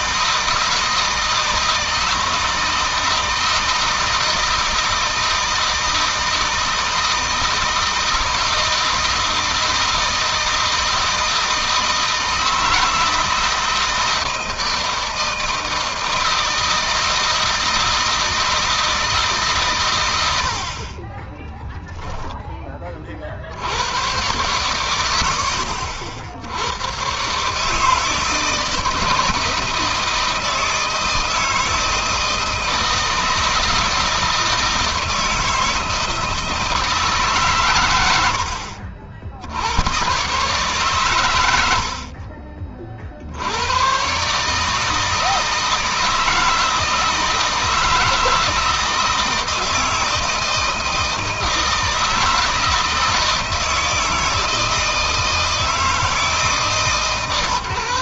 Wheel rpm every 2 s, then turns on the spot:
160, 160, 160, 160, 160, 160, 160, 160, 160, 160, 30, 50, 80, 120, 160, 160, 160, 160, 150, 60, 120, 50, 160, 160, 160, 160, 160, 160, 140.
none